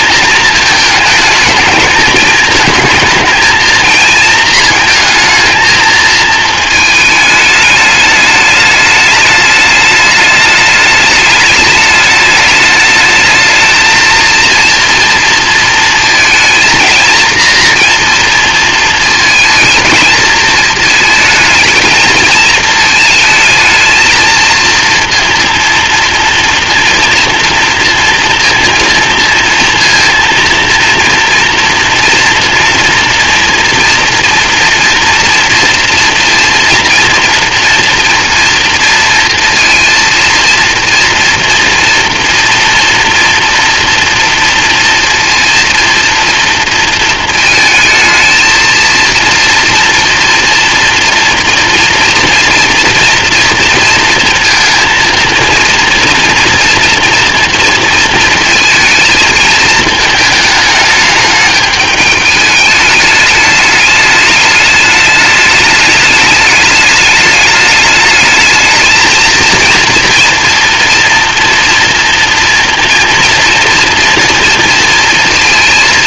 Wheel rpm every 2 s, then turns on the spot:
220, 220, 220, 220, 210, 210, 210, 230, 230, 230, 220, 220, 230, 230, 230, 230, 230, 230, 230, 230, 230, 230, 230, 230, 230, 230, 230, 230, 240, 230, 210, 210, 210, 210, 220, 230, 240, 230.
none